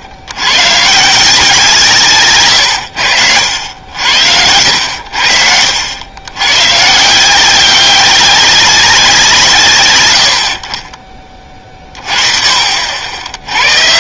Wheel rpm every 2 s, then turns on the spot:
110, 120, 80, 140, 190, 50, 60.
2-6